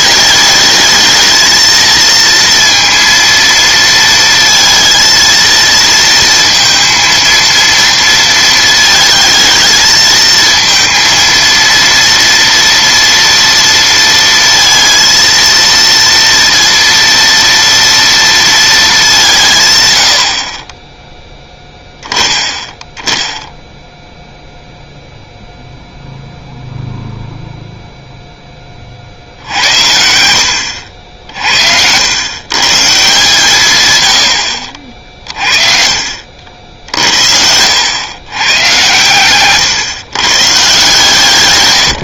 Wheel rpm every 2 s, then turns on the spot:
210, 230, 230, 230, 220, 230, 230, 230, 230, 220, 30, 10, 0, 0, 20, 80, 140, 60, 70, 120, 130.
none